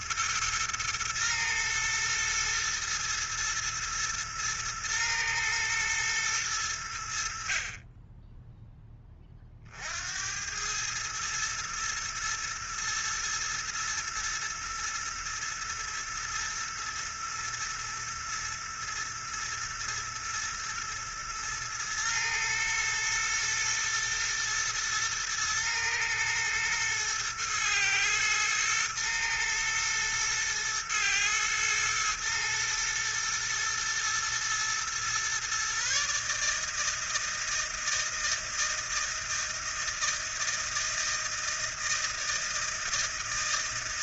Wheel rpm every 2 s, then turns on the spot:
110, 120, 110, 90, 10, 110, 110, 110, 120, 120, 120, 110, 110, 120, 110, 110, 120, 120, 160, 160, 160, 160.
none